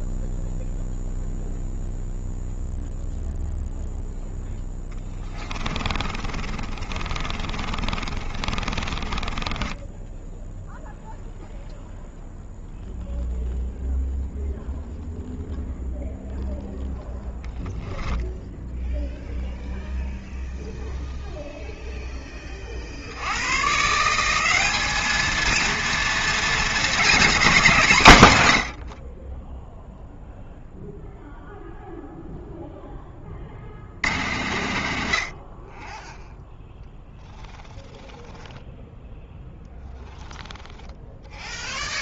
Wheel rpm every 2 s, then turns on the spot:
0, 0, 10, 30, 20, 0, 0, 0, 10, 0, 0, 70, 220, 230, 40, 0, 10, 60, 0, 0, 0.
4-10